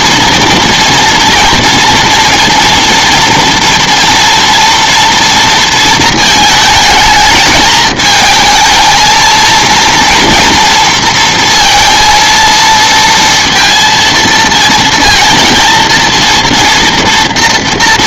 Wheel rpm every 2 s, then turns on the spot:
230, 230, 230, 220, 220, 230, 230, 230, 230.
none